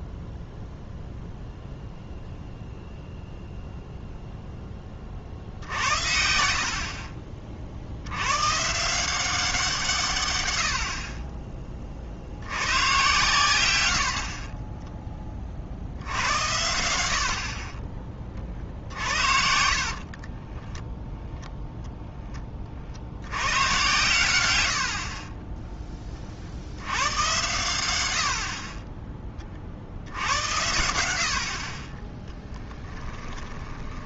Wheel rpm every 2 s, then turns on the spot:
0, 0, 10, 60, 140, 80, 100, 10, 80, 40, 10, 40, 100, 60, 50, 80, 10.
20-22 24-26 32-34